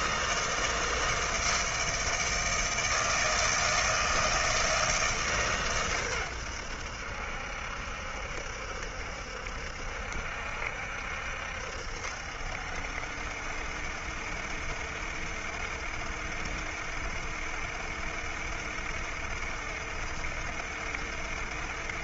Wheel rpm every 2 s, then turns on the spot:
160, 160, 160, 90, 70, 70, 70, 60, 70, 70, 70.
none